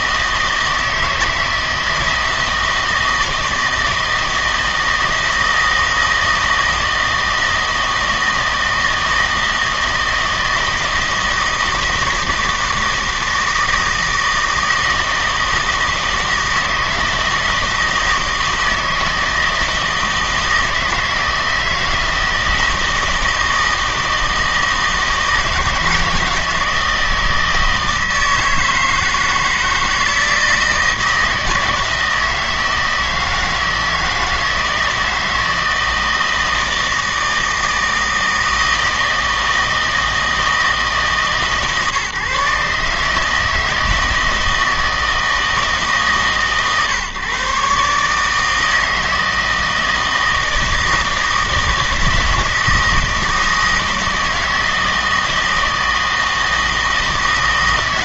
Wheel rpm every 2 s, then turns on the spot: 160, 160, 160, 160, 160, 160, 160, 160, 160, 160, 160, 160, 160, 160, 160, 160, 160, 160, 160, 160, 160, 150, 160, 140, 160, 160, 160, 160, 160.
none